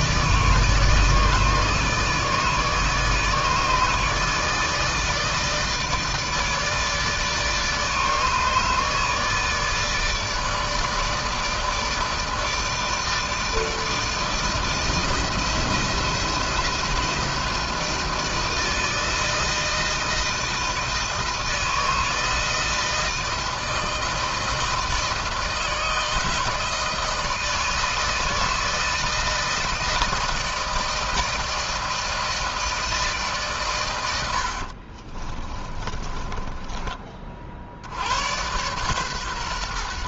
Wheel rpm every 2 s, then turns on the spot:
160, 150, 160, 160, 160, 160, 160, 160, 170, 160, 160, 160, 160, 160, 160, 160, 160, 60, 20, 110.
34-36